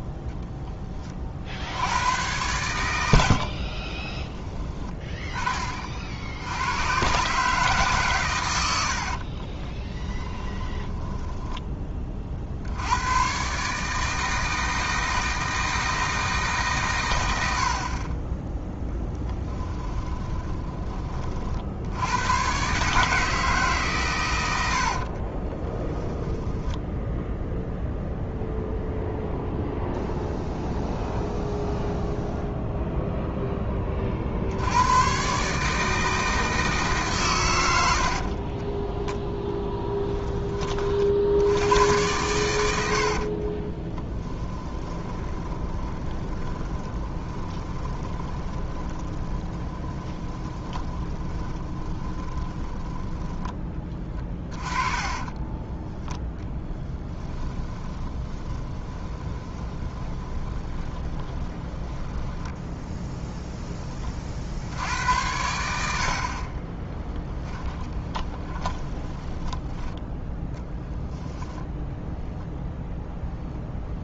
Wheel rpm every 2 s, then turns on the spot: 20, 90, 20, 110, 70, 10, 80, 160, 130, 10, 20, 140, 70, 0, 0, 0, 0, 90, 150, 20, 40, 90, 20, 20, 30, 20, 10, 20, 10, 20, 20, 10, 90, 20, 10, 0, 0.
8-12 24-26 38-40 42-62 66-70